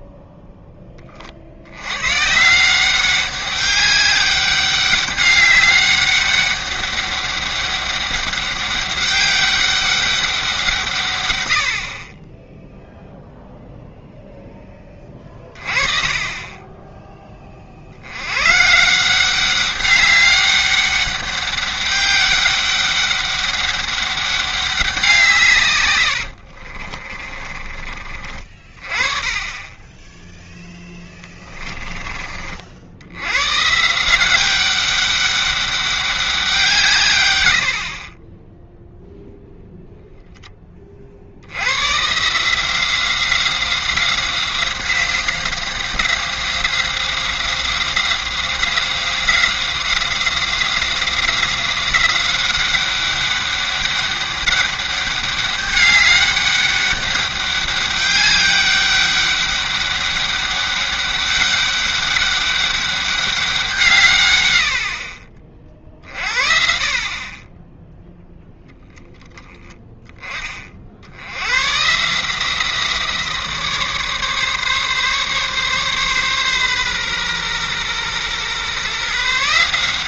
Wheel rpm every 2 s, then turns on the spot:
10, 170, 200, 200, 200, 170, 0, 10, 20, 140, 200, 190, 190, 40, 30, 10, 60, 190, 160, 0, 30, 170, 190, 190, 190, 180, 190, 200, 200, 200, 200, 200, 70, 50, 10, 50, 170, 140, 130, 140.
26-28 30-32